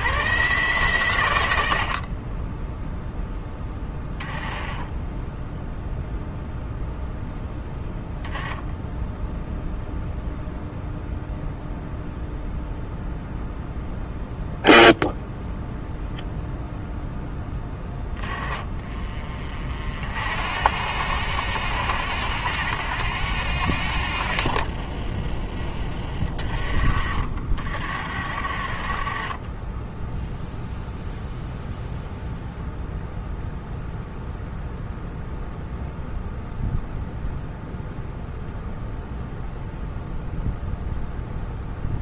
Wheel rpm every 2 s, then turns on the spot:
120, 0, 10, 0, 10, 0, 0, 0, 0, 30, 70, 80, 40, 50, 40, 0, 0, 0, 0, 0, 0.
4-6